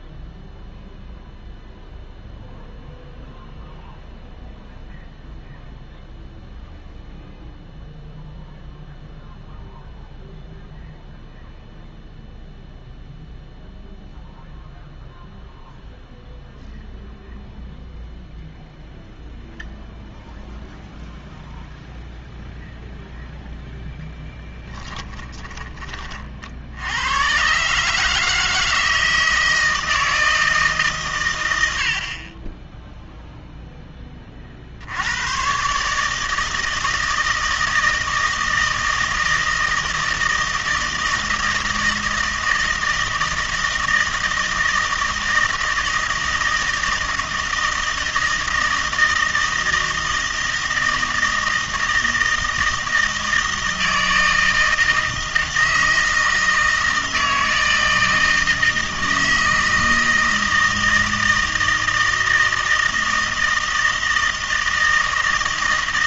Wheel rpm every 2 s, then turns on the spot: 0, 0, 0, 0, 0, 0, 0, 0, 0, 0, 0, 0, 10, 70, 160, 150, 10, 60, 160, 160, 160, 160, 160, 160, 160, 160, 160, 160, 160, 160, 160, 160, 160.
24-26